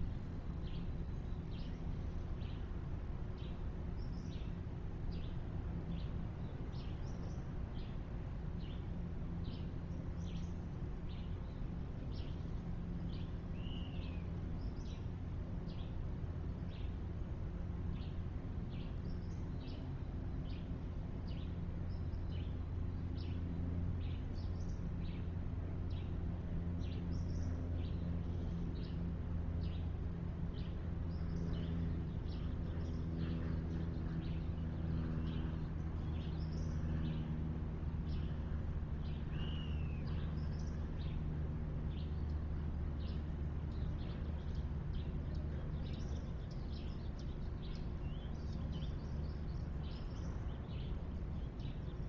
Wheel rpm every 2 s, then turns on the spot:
0, 0, 0, 0, 0, 0, 0, 0, 0, 0, 0, 0, 0, 0, 0, 0, 0, 0, 0, 0, 0, 0, 0, 0, 0, 0.
none